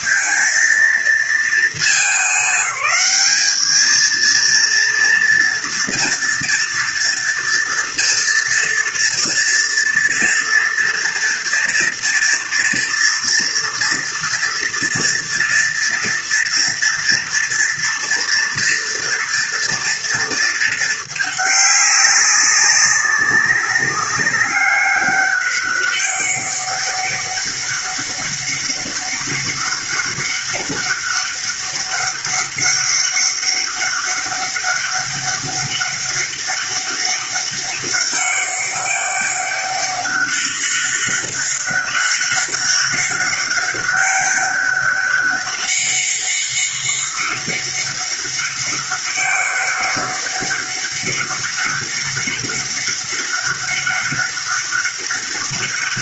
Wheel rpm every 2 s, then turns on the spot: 230, 210, 230, 230, 230, 230, 230, 230, 230, 230, 220, 200, 200, 200, 200, 200, 200, 200, 200, 200, 200, 200, 200, 200, 200, 200, 200, 200.
none